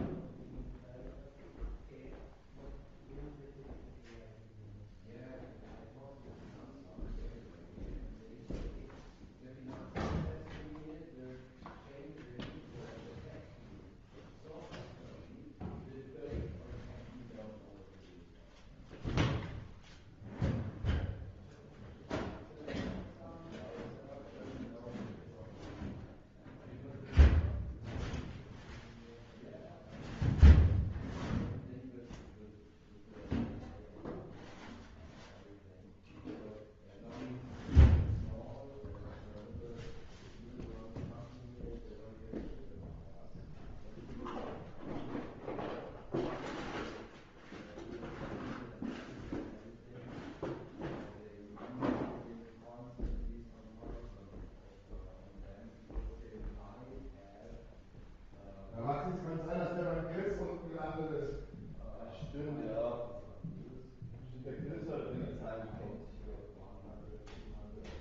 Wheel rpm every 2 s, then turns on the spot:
0, 0, 0, 0, 0, 0, 0, 0, 0, 0, 0, 0, 0, 0, 0, 0, 0, 0, 0, 0, 0, 0, 0, 0, 0, 0, 0, 0, 0, 0, 0, 0, 0, 0.
none